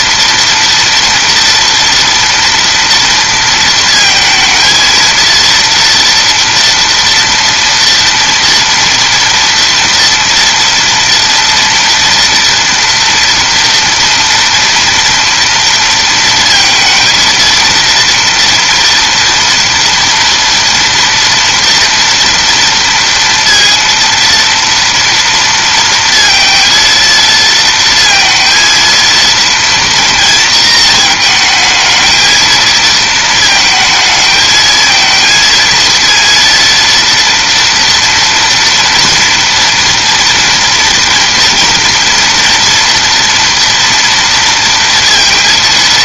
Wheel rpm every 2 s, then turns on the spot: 240, 230, 230, 240, 230, 230, 230, 240, 230, 230, 230, 230, 230, 230, 230, 230, 220, 220, 230, 230, 230, 230, 230.
none